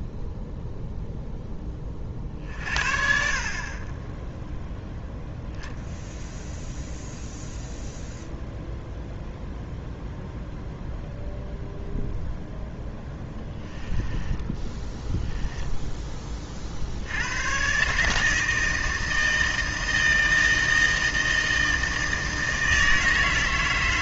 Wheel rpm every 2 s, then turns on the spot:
0, 50, 0, 0, 0, 0, 10, 10, 60, 160, 160, 160.
12-16